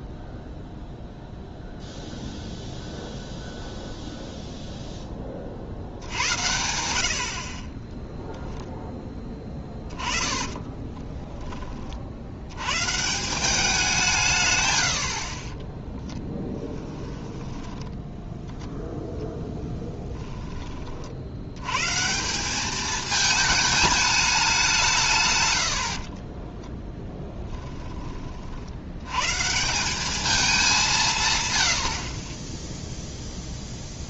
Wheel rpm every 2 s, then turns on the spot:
0, 0, 0, 90, 0, 20, 110, 110, 10, 0, 20, 190, 190, 20, 60, 200, 10.
10-12 16-18 26-28